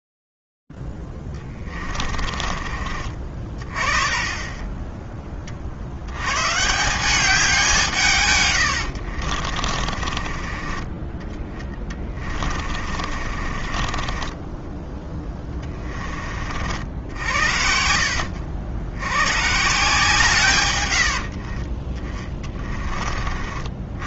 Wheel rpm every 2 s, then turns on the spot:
0, 30, 30, 140, 110, 30, 40, 20, 70, 80, 90, 30.
2-4 10-14